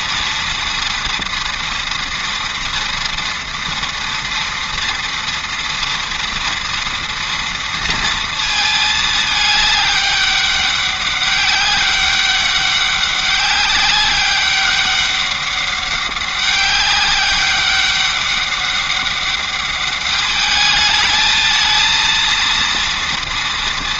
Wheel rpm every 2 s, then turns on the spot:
230, 230, 230, 230, 220, 200, 200, 200, 200, 200, 210, 230.
none